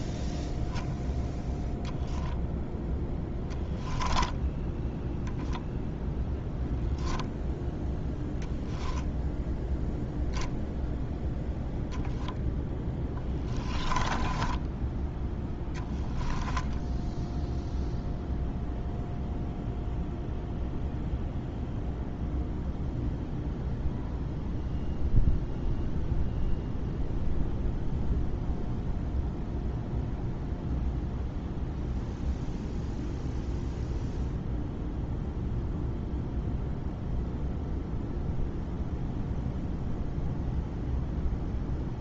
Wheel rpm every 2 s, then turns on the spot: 0, 0, 0, 0, 0, 0, 10, 10, 0, 0, 0, 0, 0, 0, 0, 0, 0, 0, 0, 0, 0.
12-14